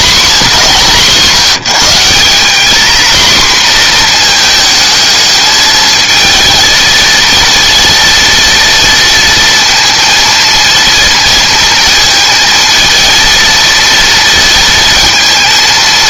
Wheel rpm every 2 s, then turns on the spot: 190, 230, 220, 230, 230, 230, 230, 230.
none